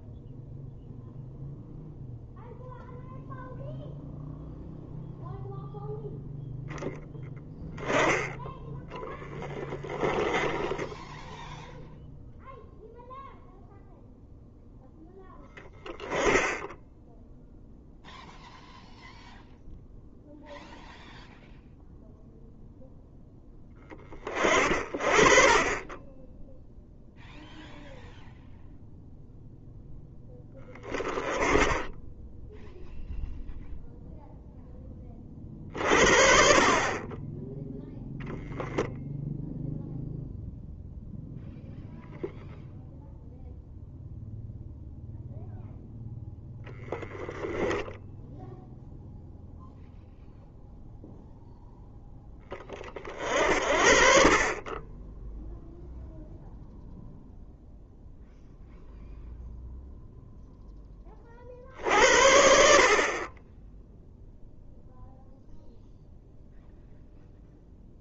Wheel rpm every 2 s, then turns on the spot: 0, 0, 0, 0, 10, 10, 0, 0, 0, 0, 0, 0, 30, 0, 0, 10, 0, 20, 30, 0, 0, 0, 0, 10, 0, 0, 30, 20, 0, 0, 10, 60, 0, 0.
46-48